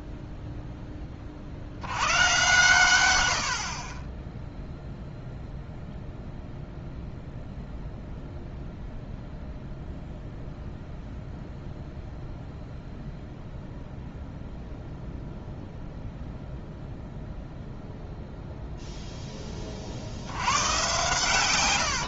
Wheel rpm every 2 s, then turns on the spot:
10, 120, 0, 0, 0, 0, 0, 0, 0, 0, 120.
none